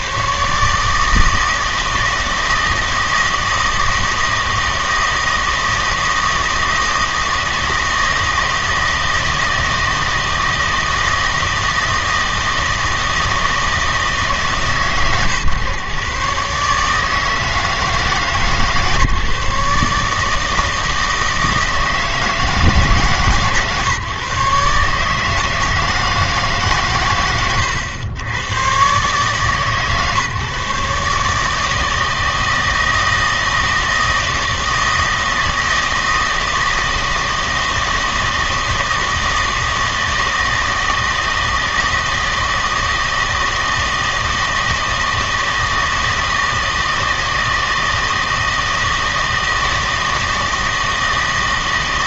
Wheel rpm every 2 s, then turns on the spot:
150, 160, 160, 160, 160, 160, 160, 140, 140, 150, 160, 150, 140, 120, 120, 150, 160, 160, 160, 160, 160, 160, 160, 160, 160, 160.
none